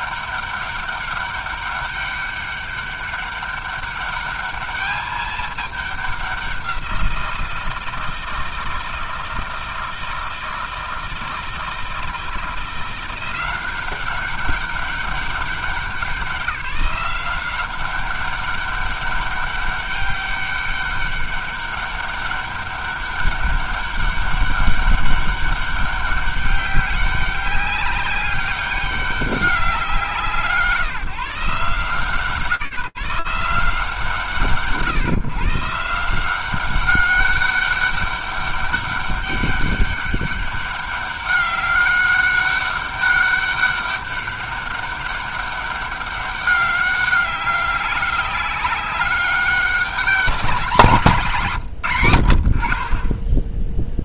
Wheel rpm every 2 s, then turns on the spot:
200, 200, 210, 190, 160, 160, 170, 200, 180, 200, 200, 200, 200, 200, 200, 150, 180, 140, 200, 200, 200, 200, 200, 200, 190, 170, 30.
none